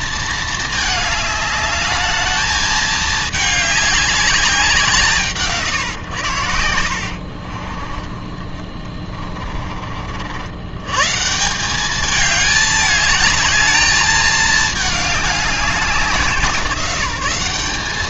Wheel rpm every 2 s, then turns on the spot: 220, 210, 190, 80, 30, 100, 210, 210, 170.
8-10